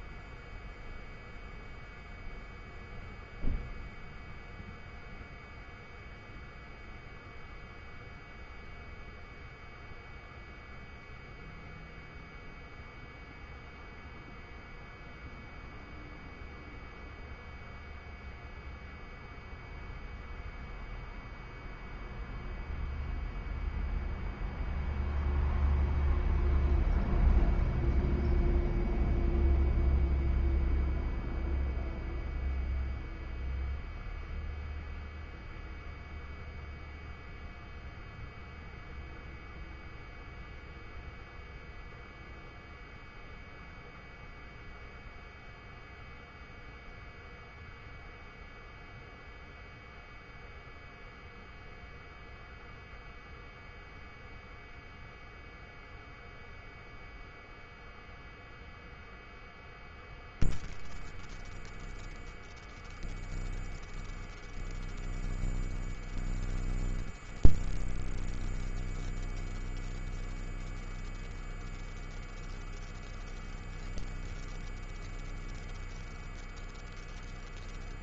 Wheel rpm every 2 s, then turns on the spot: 0, 0, 0, 0, 0, 0, 0, 0, 0, 0, 0, 0, 0, 0, 0, 0, 0, 0, 0, 0, 0, 0, 0, 0, 0, 0, 0, 0, 0, 0, 0, 0, 0, 0, 0, 0, 0, 0, 0.
none